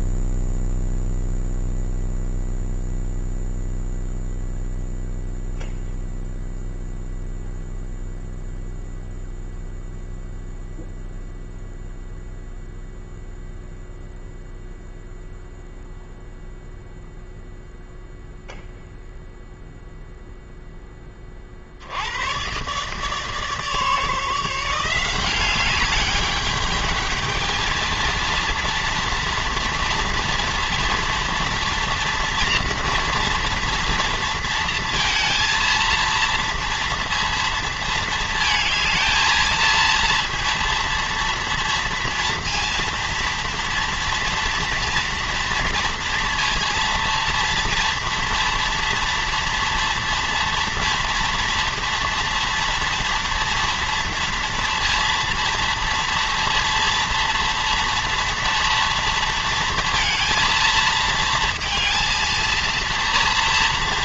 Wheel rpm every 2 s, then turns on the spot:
0, 0, 0, 0, 0, 0, 0, 0, 0, 0, 0, 120, 170, 210, 230, 230, 230, 230, 230, 220, 230, 230, 230, 230, 230, 230, 230, 230, 230, 230, 230, 230.
none